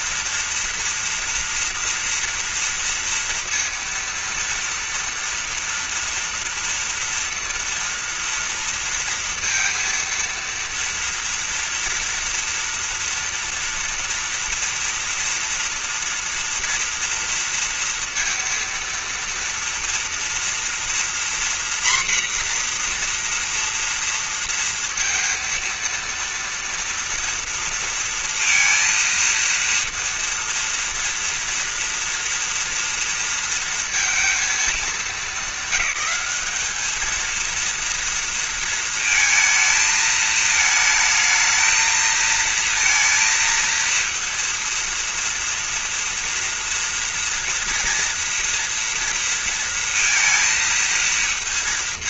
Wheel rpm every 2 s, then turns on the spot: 240, 240, 230, 230, 230, 230, 230, 240, 230, 230, 230, 250, 230, 230, 230, 230, 230, 220, 200, 230, 220, 230, 230, 230, 230, 230.
none